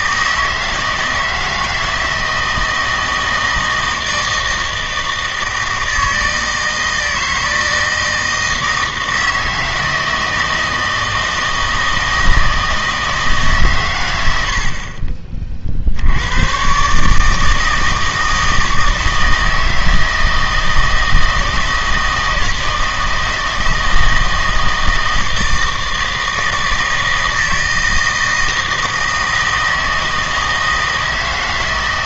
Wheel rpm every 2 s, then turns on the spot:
160, 160, 160, 160, 160, 160, 160, 50, 120, 160, 160, 160, 160, 160, 160, 160.
none